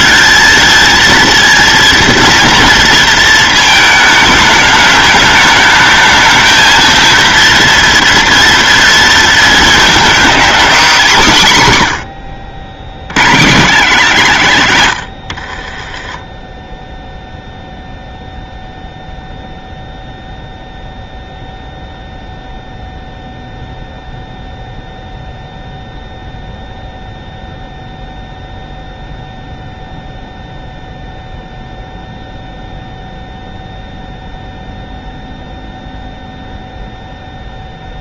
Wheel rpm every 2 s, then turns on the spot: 230, 230, 210, 220, 230, 230, 70, 150, 10, 0, 0, 0, 0, 0, 0, 0, 0, 0, 0.
none